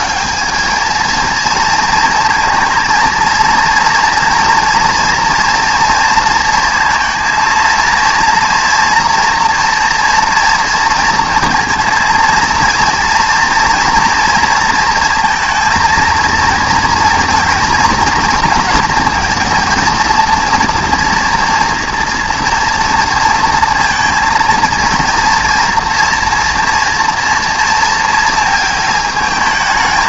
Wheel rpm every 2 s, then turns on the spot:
220, 230, 230, 230, 230, 230, 230, 230, 230, 230, 230, 230, 230, 230, 220.
none